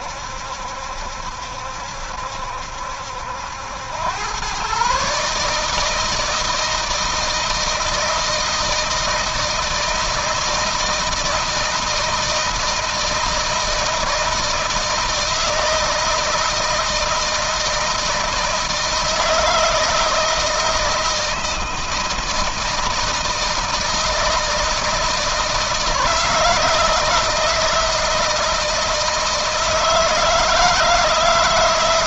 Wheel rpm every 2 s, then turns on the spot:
70, 70, 120, 160, 160, 160, 160, 160, 160, 160, 160, 160, 160, 160, 160, 160.
none